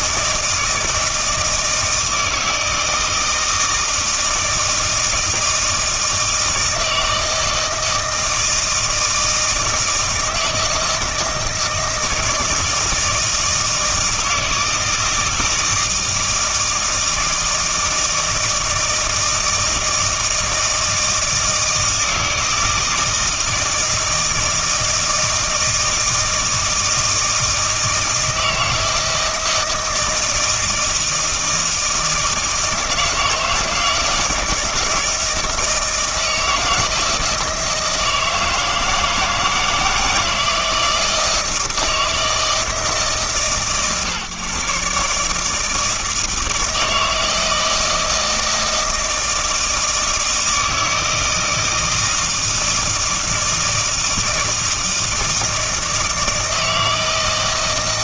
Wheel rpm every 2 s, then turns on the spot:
160, 160, 160, 160, 160, 160, 160, 160, 160, 160, 160, 160, 160, 160, 160, 160, 160, 160, 160, 160, 160, 150, 140, 160, 160, 160, 160, 160, 160.
none